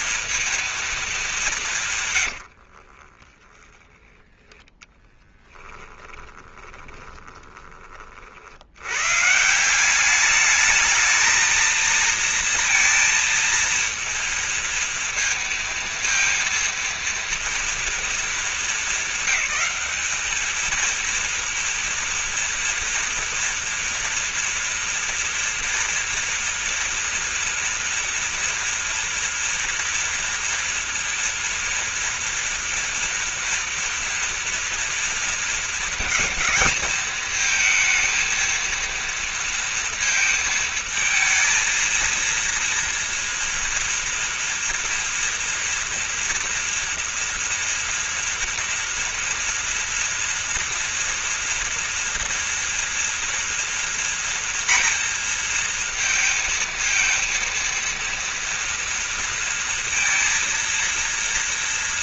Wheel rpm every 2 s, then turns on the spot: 230, 60, 10, 20, 80, 210, 230, 230, 230, 220, 220, 230, 230, 230, 230, 230, 230, 230, 220, 230, 220, 230, 230, 230, 230, 230, 230, 230, 220, 230, 230.
2-4 6-8